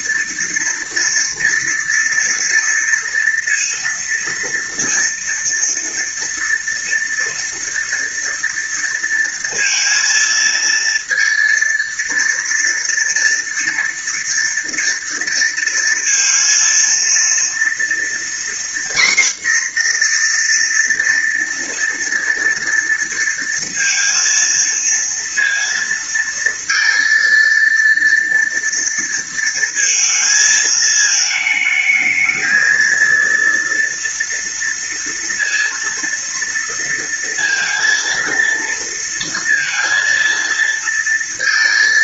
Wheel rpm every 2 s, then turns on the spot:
230, 230, 230, 230, 230, 230, 230, 230, 230, 240, 240, 230, 230, 230, 230, 220, 230, 230, 230, 230, 230.
none